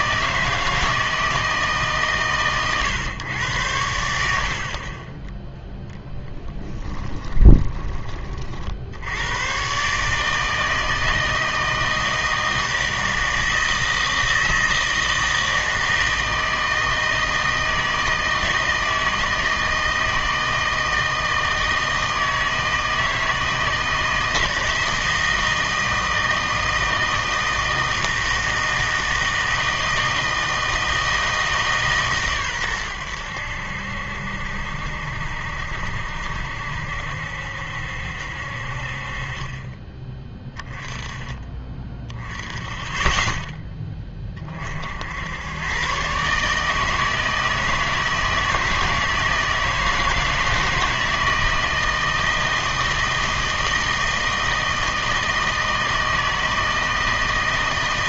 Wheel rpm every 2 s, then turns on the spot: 160, 130, 50, 10, 60, 160, 160, 160, 160, 160, 160, 160, 160, 160, 160, 160, 110, 70, 70, 50, 10, 20, 60, 150, 160, 160, 160, 160, 160.
6-8